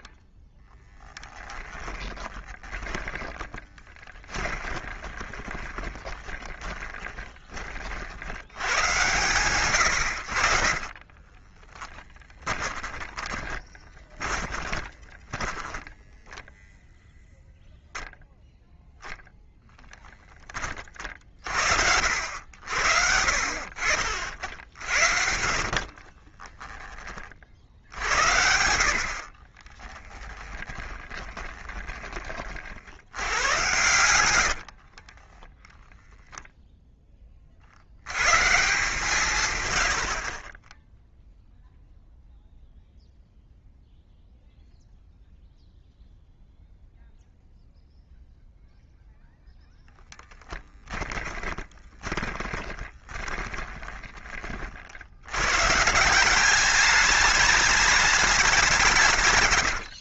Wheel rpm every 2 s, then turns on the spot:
10, 20, 20, 20, 90, 20, 20, 20, 10, 0, 30, 70, 70, 30, 70, 20, 60, 50, 10, 160, 10, 0, 0, 0, 0, 10, 20, 50, 200, 170.
0-8 12-16 26-28 30-32 34-36 50-54